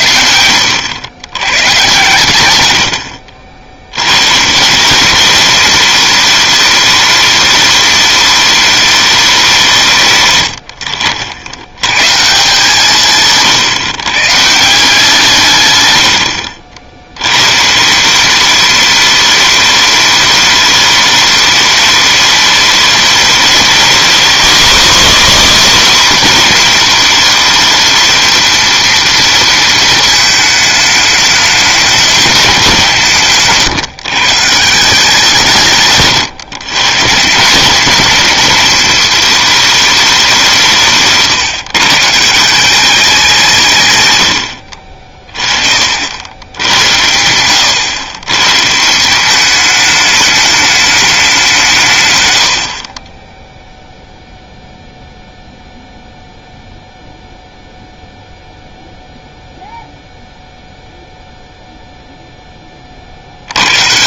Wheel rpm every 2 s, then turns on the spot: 80, 100, 160, 210, 210, 90, 160, 170, 60, 200, 210, 210, 230, 220, 230, 220, 190, 170, 130, 210, 160, 180, 60, 90, 150, 210, 50, 0, 0, 0, 0, 20.
none